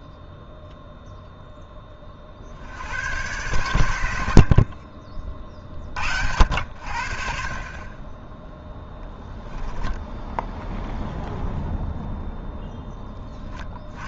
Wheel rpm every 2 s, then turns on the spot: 0, 100, 40, 70, 0, 0, 0.
none